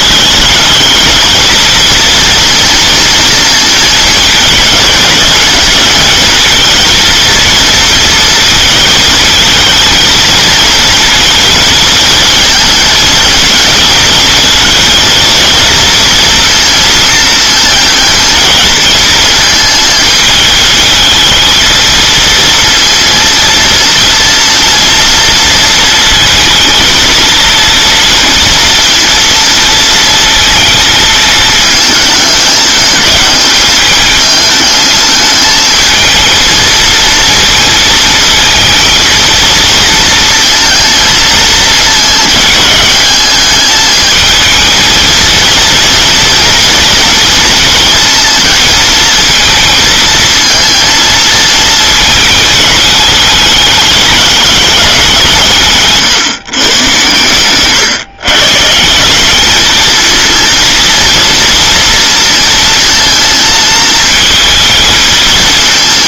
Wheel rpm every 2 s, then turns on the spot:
220, 240, 220, 230, 220, 220, 210, 230, 230, 220, 220, 230, 230, 230, 230, 220, 210, 220, 230, 230, 220, 210, 230, 230, 220, 230, 210, 190, 120, 180, 230, 230, 220.
none